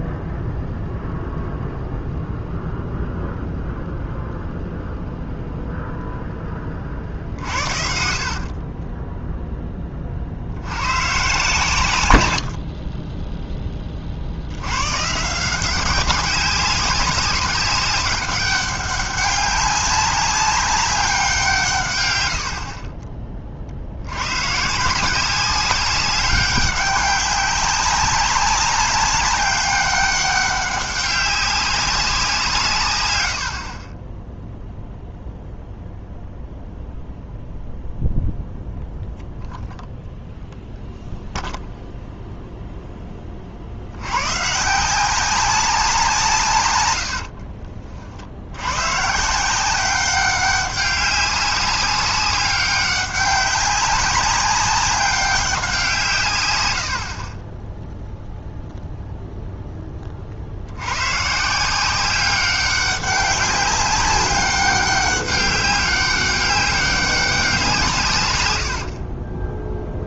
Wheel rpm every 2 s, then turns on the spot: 0, 0, 0, 40, 10, 110, 20, 130, 190, 200, 190, 30, 170, 200, 190, 200, 120, 0, 0, 0, 0, 0, 160, 100, 110, 190, 200, 200, 90, 0, 70, 190, 190, 200, 100.
6-10 68-70